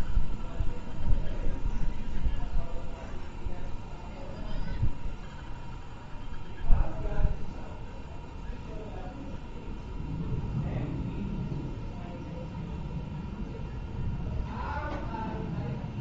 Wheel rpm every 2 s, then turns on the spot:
0, 0, 0, 0, 0, 0, 0, 0.
none